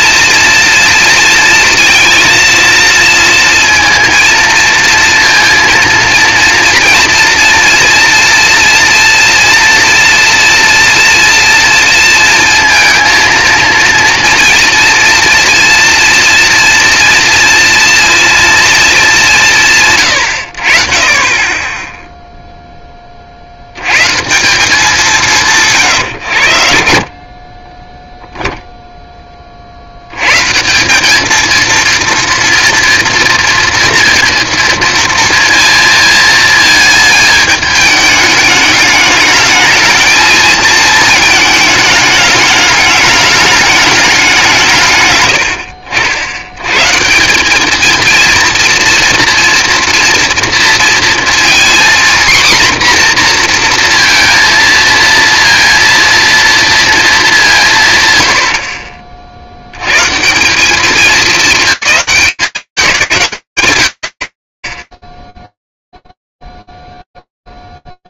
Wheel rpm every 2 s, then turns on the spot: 230, 230, 230, 230, 230, 230, 230, 230, 230, 220, 50, 10, 190, 60, 0, 170, 240, 230, 210, 210, 220, 210, 130, 120, 230, 230, 240, 230, 230, 60, 180, 190, 30, 0.
none